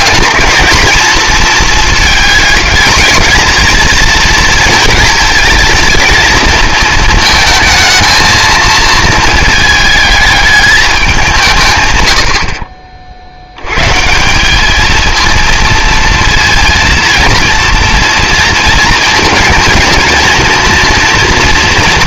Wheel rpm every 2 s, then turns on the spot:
220, 220, 230, 220, 220, 210, 50, 200, 230, 230, 230.
none